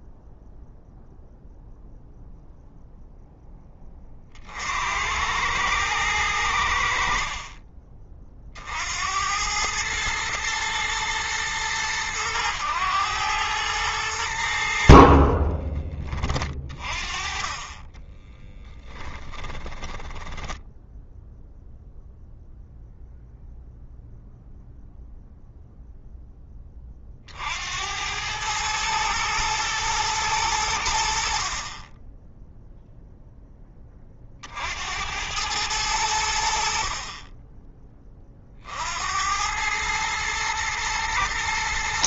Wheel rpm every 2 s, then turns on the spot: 0, 0, 80, 80, 60, 110, 100, 60, 30, 30, 10, 0, 0, 30, 110, 90, 0, 70, 50, 70, 110.
18-22